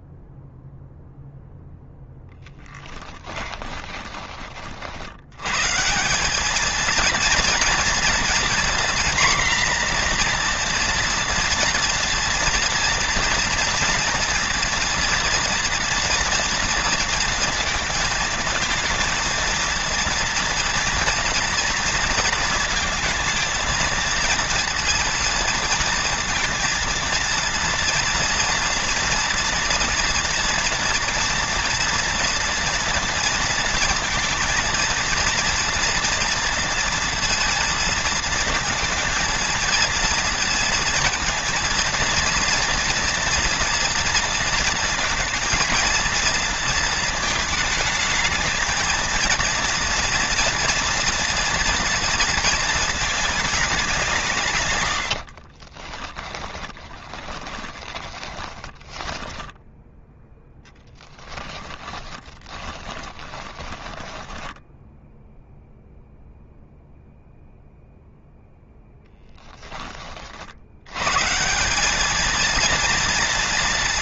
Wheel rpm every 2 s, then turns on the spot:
0, 10, 70, 230, 240, 230, 230, 230, 230, 220, 230, 220, 230, 230, 230, 230, 230, 230, 230, 230, 230, 230, 230, 230, 220, 230, 220, 80, 10, 10, 10, 20, 0, 0, 10, 110, 230.
2-4 54-64